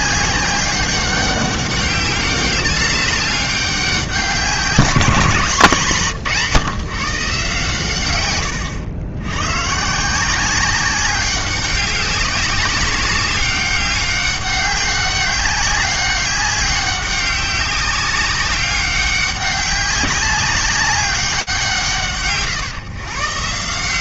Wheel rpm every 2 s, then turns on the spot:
200, 200, 180, 130, 110, 190, 190, 200, 200, 200, 200, 140.
none